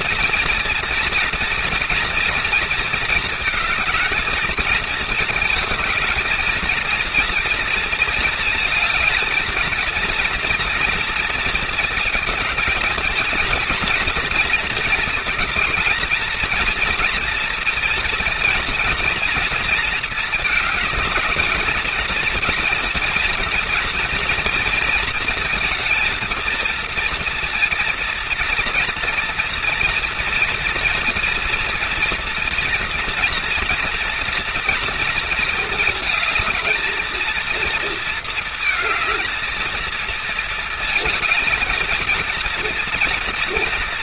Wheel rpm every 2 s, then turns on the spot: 240, 230, 220, 230, 230, 230, 230, 230, 220, 240, 210, 220, 230, 230, 230, 230, 230, 230, 220, 220, 220, 230.
none